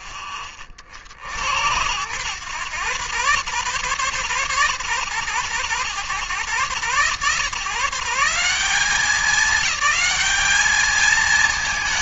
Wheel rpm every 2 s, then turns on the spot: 60, 100, 80, 110, 200, 220.
none